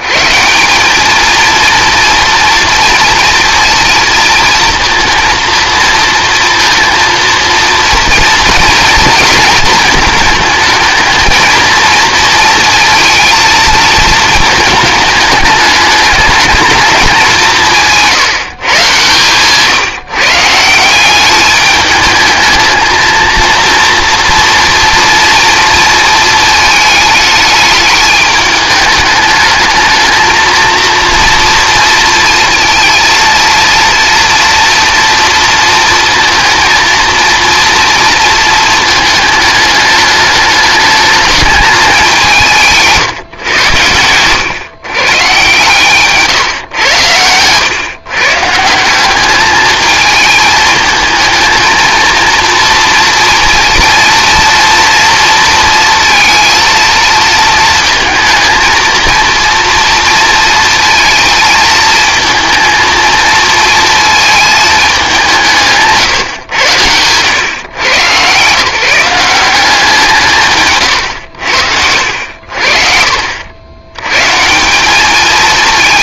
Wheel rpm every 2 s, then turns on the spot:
200, 230, 230, 230, 230, 220, 230, 220, 220, 140, 170, 220, 230, 220, 210, 230, 230, 230, 230, 220, 210, 160, 130, 100, 180, 220, 230, 230, 230, 230, 230, 230, 210, 100, 170, 120, 50, 200.
none